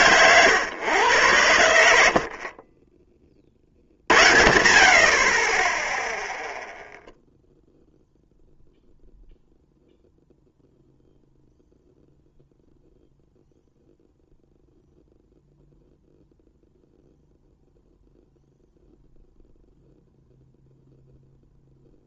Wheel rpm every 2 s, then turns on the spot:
110, 20, 80, 0, 0, 0, 0, 0, 0, 0, 0.
none